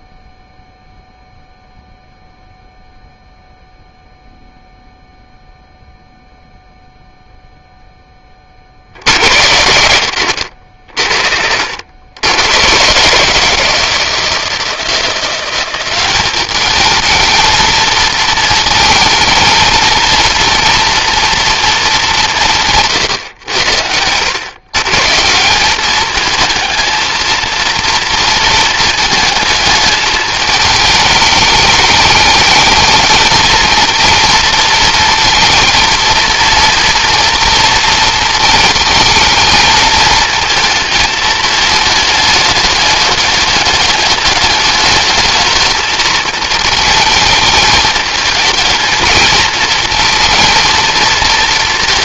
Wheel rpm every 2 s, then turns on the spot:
0, 0, 0, 0, 60, 60, 120, 160, 210, 220, 230, 150, 140, 230, 230, 220, 220, 230, 230, 220, 220, 210, 210, 220, 220, 230.
none